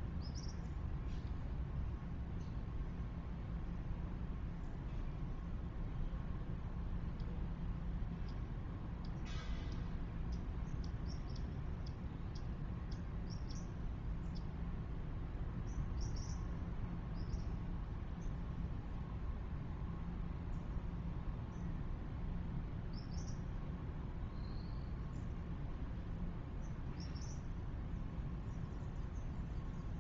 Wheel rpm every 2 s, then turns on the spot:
0, 0, 0, 0, 0, 0, 0, 0, 0, 0, 0, 0, 0, 0, 0.
none